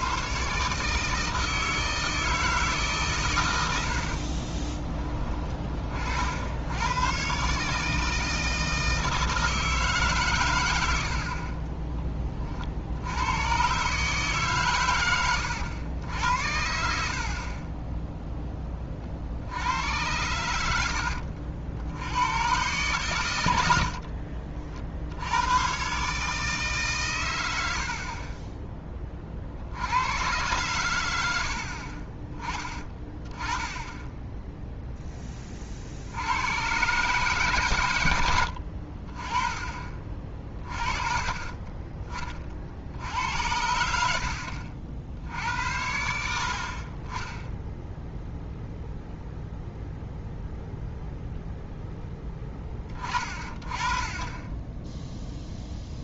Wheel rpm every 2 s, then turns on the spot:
140, 160, 30, 80, 160, 110, 50, 130, 70, 20, 80, 120, 50, 150, 20, 110, 20, 0, 110, 60, 30, 50, 60, 60, 0, 0, 20, 10.
4-6